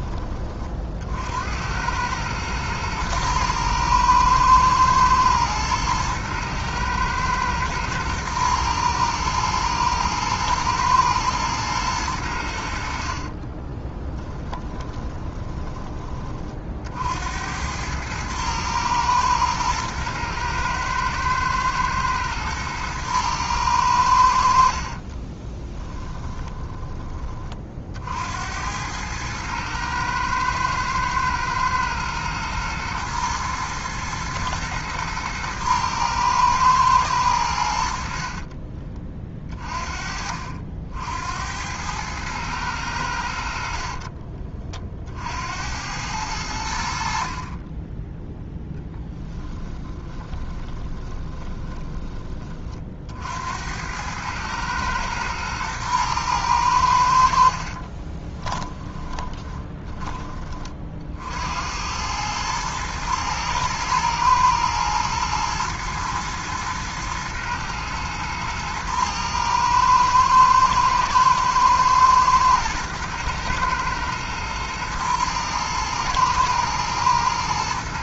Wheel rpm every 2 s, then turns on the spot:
50, 110, 110, 110, 110, 110, 60, 20, 60, 110, 110, 110, 40, 20, 100, 110, 120, 120, 110, 30, 70, 100, 50, 70, 10, 20, 50, 110, 80, 20, 60, 110, 110, 110, 110, 110, 110, 110, 110.
14-16 24-26 48-52 58-60